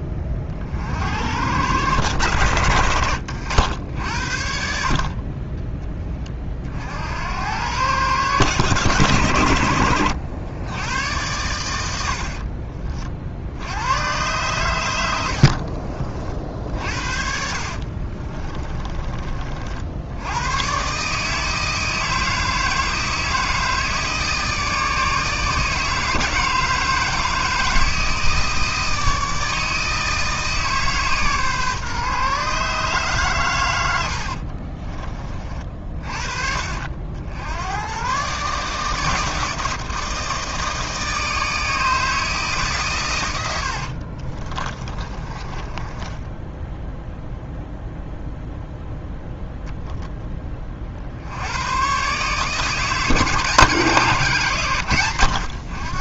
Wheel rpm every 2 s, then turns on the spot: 70, 80, 50, 60, 120, 90, 50, 90, 60, 30, 130, 160, 160, 160, 160, 150, 140, 30, 60, 150, 160, 120, 30, 0, 0, 50, 160, 120.
18-20 44-46